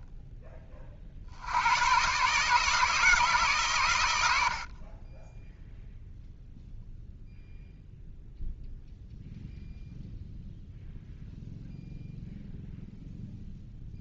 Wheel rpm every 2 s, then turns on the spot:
30, 160, 50, 0, 0, 0, 0.
none